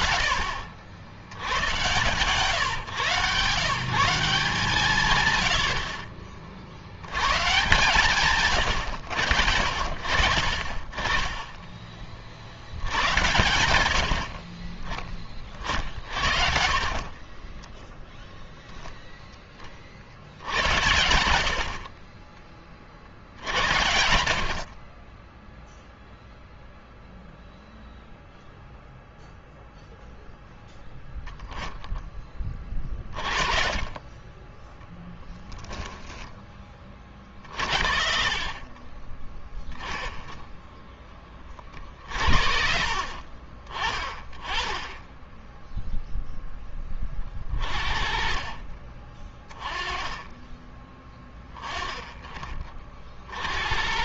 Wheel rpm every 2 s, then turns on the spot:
60, 130, 170, 60, 130, 50, 60, 40, 60, 0, 70, 30, 40, 0, 0, 0, 20, 10, 20, 40, 10, 50, 20, 10, 40, 20, 30.
16-18 38-40